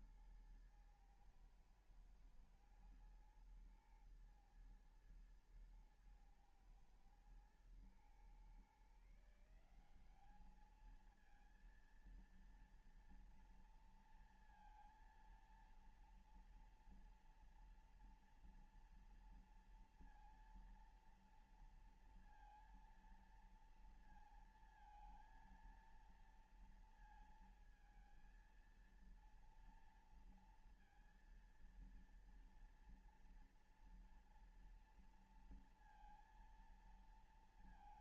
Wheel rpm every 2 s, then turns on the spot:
110, 110, 110, 110, 120, 190, 230, 230, 230, 230, 230, 230, 230, 230, 230, 230, 230, 230, 230.
none